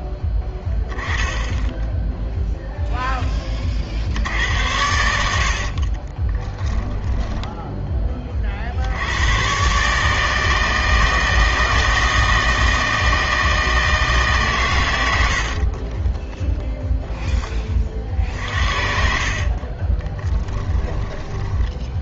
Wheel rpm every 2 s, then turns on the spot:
10, 0, 80, 10, 70, 160, 160, 120, 0, 60, 10.
6-8 18-22